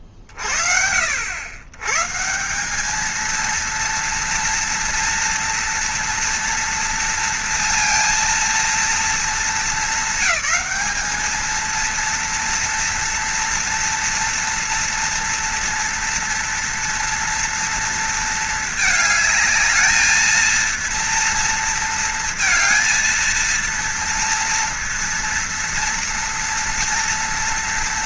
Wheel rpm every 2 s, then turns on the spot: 40, 190, 230, 230, 230, 210, 230, 230, 230, 220, 230, 230, 230, 230.
none